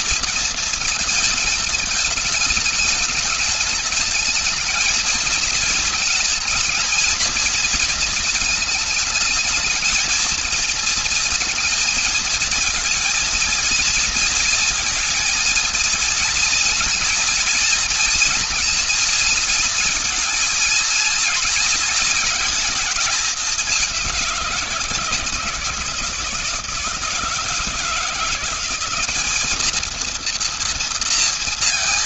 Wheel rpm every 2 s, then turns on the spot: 230, 220, 220, 230, 220, 230, 230, 230, 230, 230, 230, 220, 180, 160, 180, 230.
none